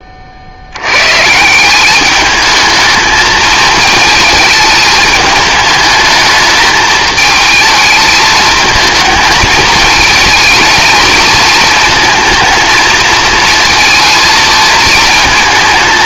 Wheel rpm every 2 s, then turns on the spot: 80, 220, 220, 220, 220, 220, 220, 230.
none